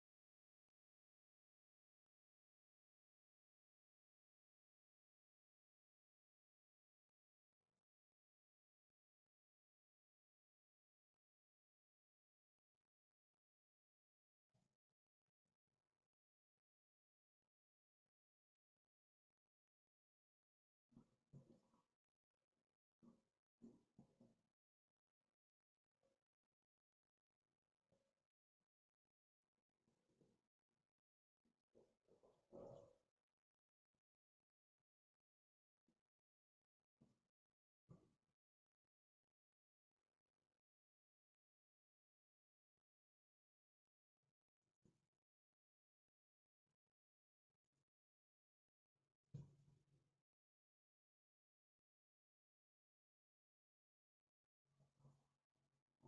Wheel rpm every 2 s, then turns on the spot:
0, 0, 0, 0, 0, 0, 0, 0, 0, 0, 0, 0, 0, 0, 0, 0, 0, 0, 0, 0, 0, 0, 0, 0, 0, 0, 0, 0.
none